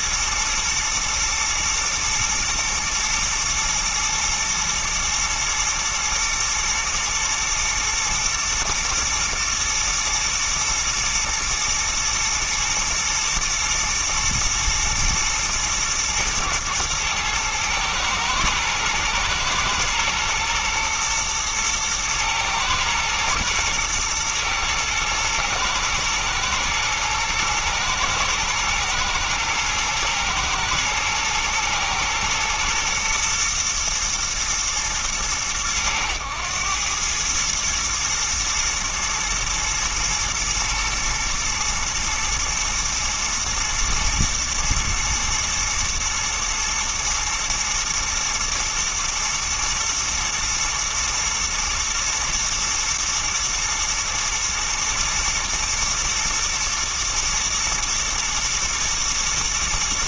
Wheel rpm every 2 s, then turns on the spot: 110, 110, 120, 110, 120, 120, 110, 110, 110, 110, 110, 110, 110, 110, 110, 110, 110, 110, 100, 120, 120, 110, 110, 120, 110, 110, 110, 110, 120, 110.
none